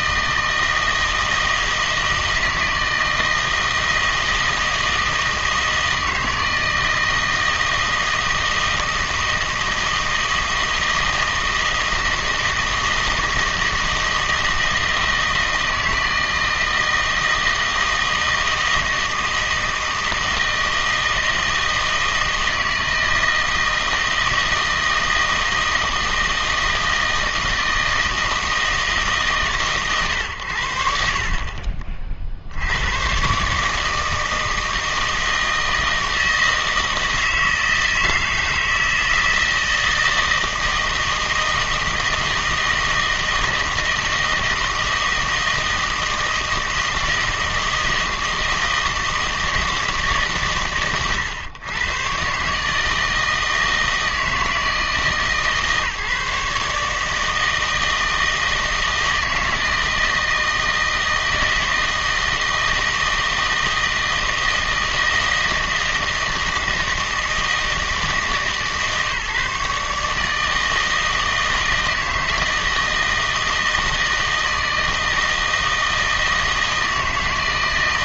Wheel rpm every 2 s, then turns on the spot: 160, 160, 160, 160, 160, 160, 160, 160, 160, 160, 160, 160, 160, 160, 160, 40, 90, 160, 160, 160, 160, 160, 160, 160, 160, 120, 160, 160, 150, 160, 160, 160, 160, 160, 150, 160, 160, 160, 170.
none